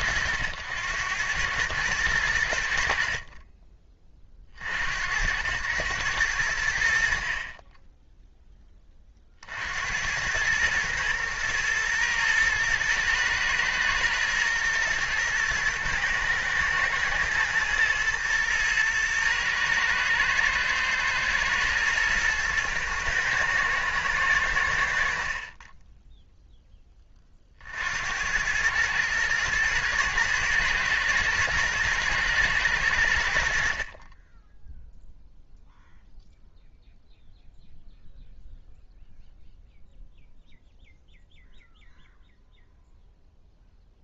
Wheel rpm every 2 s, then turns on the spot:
90, 70, 80, 70, 10, 110, 110, 110, 120, 120, 110, 110, 80, 10, 110, 110, 100, 0, 0, 0, 0, 0.
none